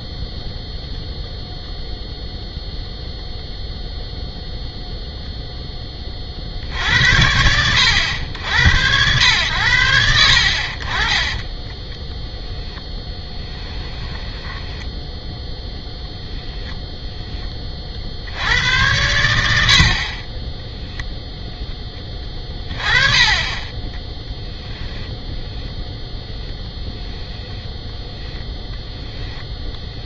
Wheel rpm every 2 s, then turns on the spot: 0, 0, 0, 60, 90, 40, 10, 10, 0, 90, 0, 20, 10, 10, 0.
14-16 22-28